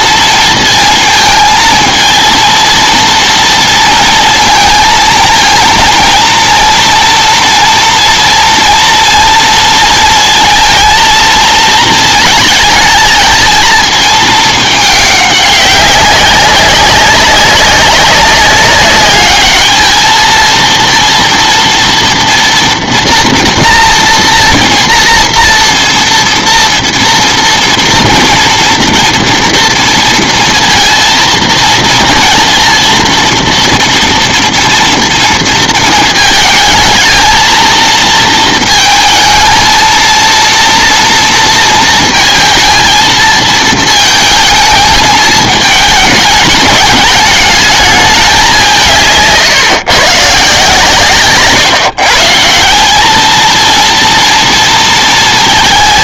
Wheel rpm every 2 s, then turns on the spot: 230, 230, 220, 230, 240, 230, 220, 210, 190, 200, 220, 240, 240, 230, 230, 230, 230, 240, 220, 220, 230, 220, 220, 210, 190, 150, 160, 230.
none